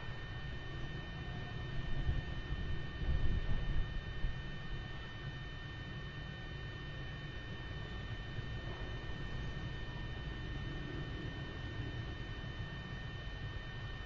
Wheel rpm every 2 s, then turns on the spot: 0, 0, 0, 0, 0, 0, 0.
none